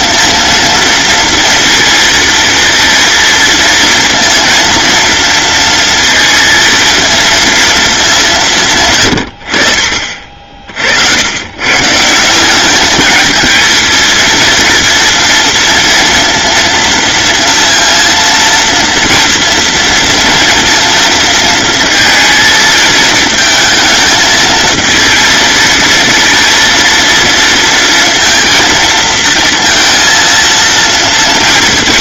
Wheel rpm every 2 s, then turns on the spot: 230, 230, 230, 230, 160, 50, 190, 230, 230, 230, 230, 230, 230, 230, 230, 230.
none